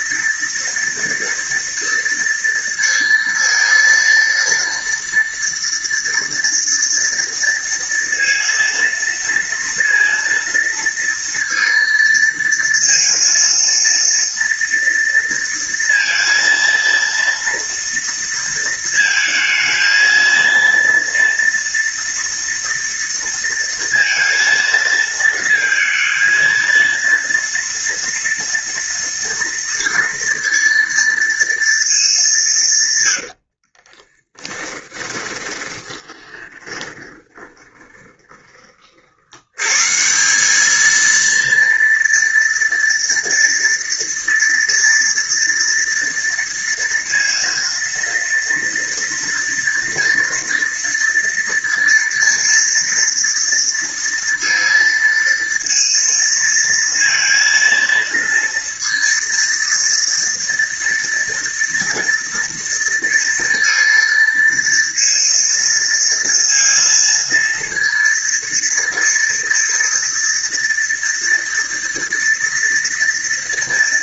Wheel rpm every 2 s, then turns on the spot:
230, 230, 230, 230, 230, 230, 230, 230, 230, 220, 230, 230, 230, 230, 230, 230, 130, 20, 10, 50, 220, 230, 230, 230, 230, 230, 230, 230, 230, 230, 230, 230, 230, 230, 230, 230, 230.
32-38